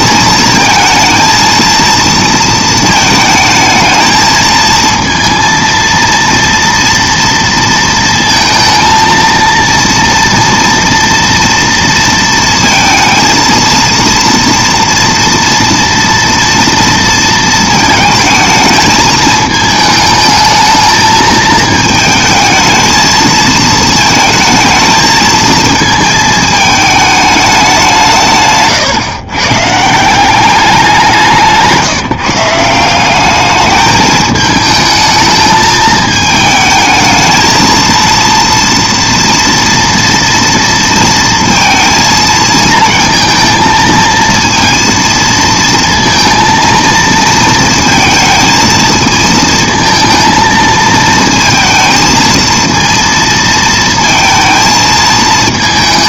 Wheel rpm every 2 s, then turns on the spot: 230, 220, 230, 230, 230, 230, 230, 240, 230, 220, 220, 220, 220, 210, 120, 180, 190, 220, 220, 230, 230, 230, 230, 230, 220, 220, 230, 220.
none